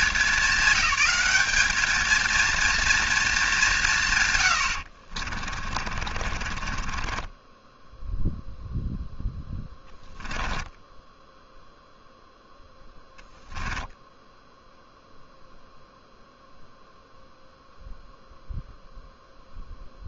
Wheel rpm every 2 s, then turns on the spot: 210, 230, 80, 20, 0, 10, 0, 0, 0, 0.
4-8 10-12